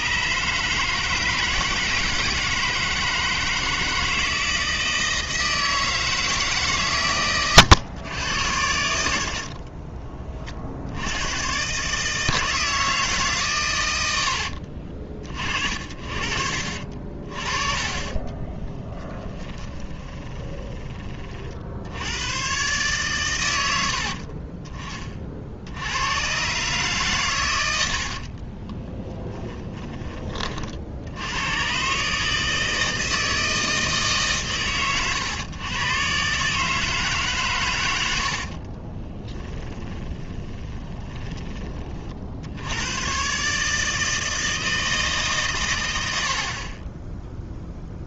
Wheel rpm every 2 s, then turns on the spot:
150, 160, 160, 140, 70, 70, 160, 50, 40, 20, 30, 130, 30, 130, 20, 60, 160, 130, 150, 30, 20, 100, 160, 20.
18-20 28-30 38-42